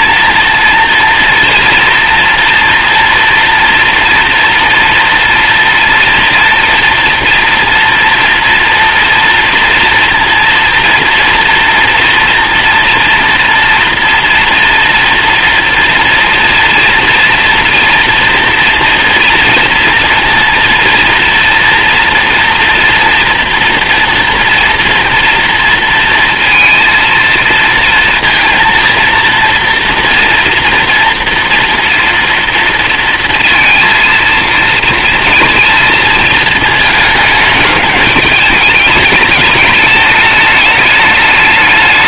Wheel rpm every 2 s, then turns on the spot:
230, 230, 230, 230, 230, 230, 230, 230, 230, 230, 230, 240, 230, 230, 230, 230, 230, 230, 220, 210, 220.
none